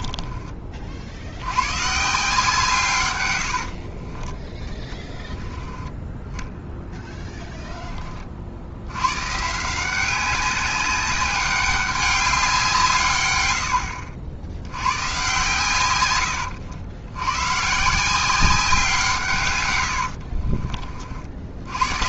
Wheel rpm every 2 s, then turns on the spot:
40, 150, 10, 10, 70, 190, 170, 90, 90, 180, 50.
6-8 20-22